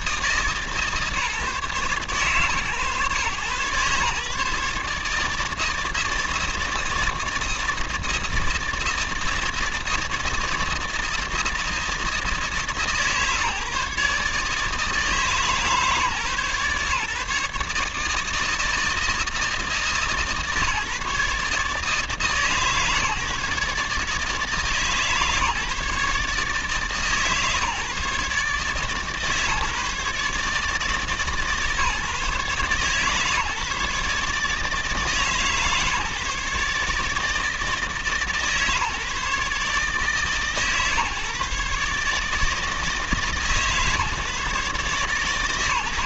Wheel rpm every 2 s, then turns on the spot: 140, 130, 150, 160, 160, 160, 140, 150, 140, 160, 140, 150, 150, 150, 150, 150, 140, 150, 150, 140, 130, 160, 140.
none